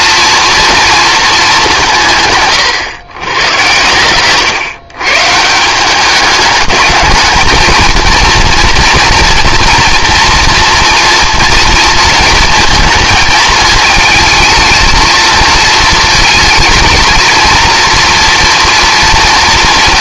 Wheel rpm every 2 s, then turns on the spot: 230, 130, 140, 210, 230, 230, 230, 220, 220, 230.
none